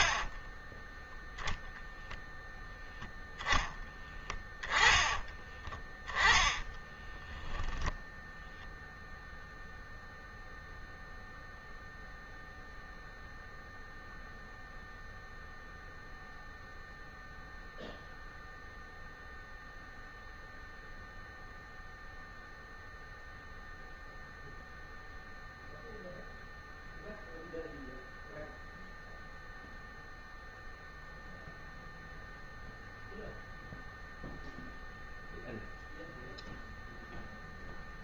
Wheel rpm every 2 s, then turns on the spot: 0, 0, 10, 10, 0, 0, 0, 0, 0, 0, 0, 0, 0, 0, 0, 0, 0, 0, 0.
6-8